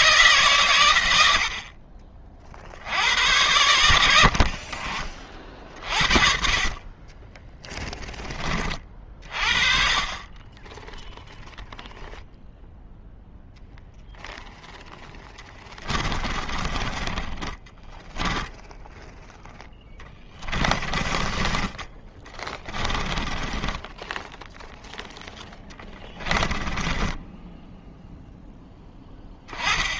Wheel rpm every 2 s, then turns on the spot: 120, 70, 40, 30, 40, 10, 0, 0, 20, 10, 20, 10, 0, 10, 10.
16-24 26-28